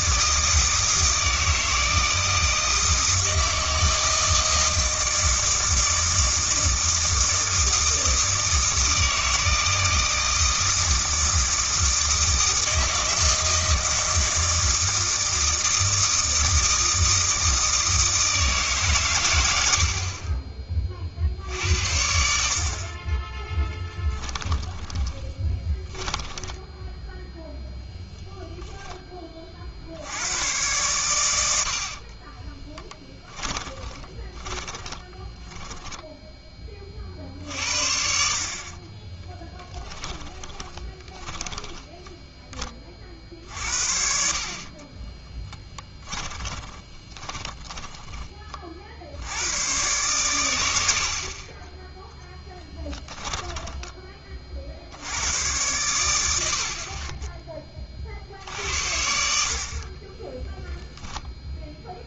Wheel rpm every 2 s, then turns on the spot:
160, 160, 160, 160, 160, 160, 160, 160, 160, 140, 40, 40, 10, 10, 10, 110, 20, 30, 30, 30, 20, 30, 30, 20, 40, 80, 10, 60, 60, 60, 0.
24-28 32-36 38-42 44-48 52-54